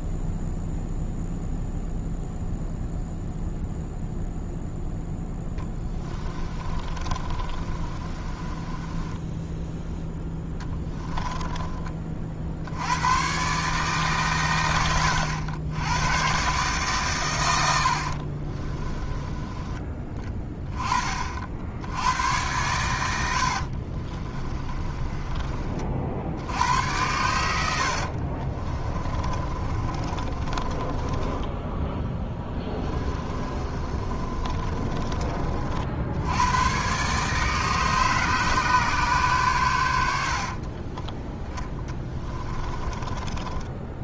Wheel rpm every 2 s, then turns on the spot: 0, 0, 0, 30, 20, 10, 80, 100, 130, 20, 20, 100, 20, 80, 30, 30, 20, 30, 120, 140, 30, 20.
6-12 18-20 24-26 28-36 40-44